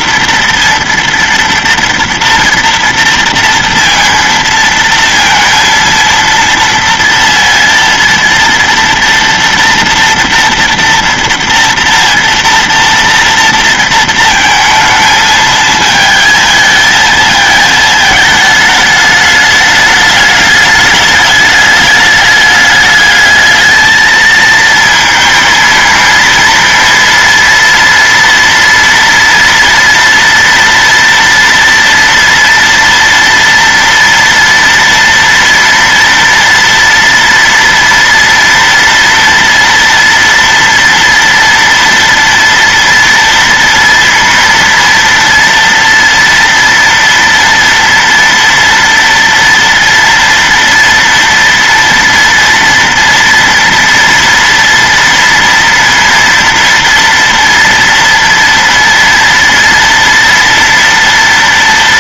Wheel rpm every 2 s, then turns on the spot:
240, 230, 230, 230, 230, 230, 230, 220, 220, 220, 210, 210, 220, 230, 230, 230, 230, 230, 230, 230, 230, 230, 230, 230, 230, 230, 230, 240, 240, 240, 230.
none